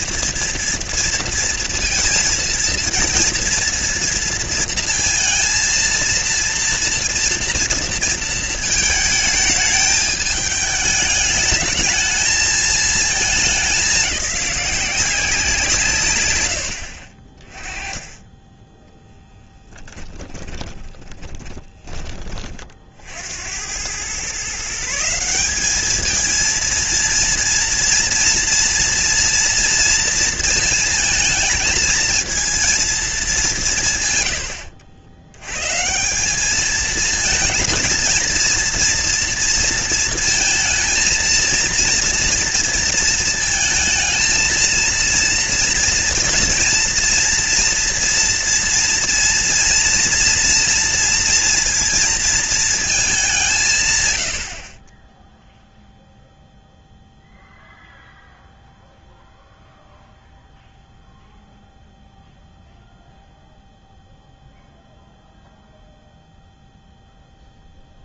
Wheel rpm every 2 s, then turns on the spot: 230, 230, 230, 230, 220, 210, 220, 190, 80, 10, 20, 40, 150, 230, 230, 220, 220, 90, 210, 230, 230, 230, 230, 240, 240, 230, 230, 50, 0, 0, 0, 0, 0, 0.
20-22